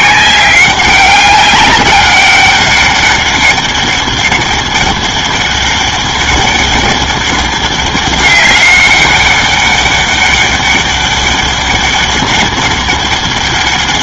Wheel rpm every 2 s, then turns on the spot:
190, 200, 200, 200, 200, 200, 200.
none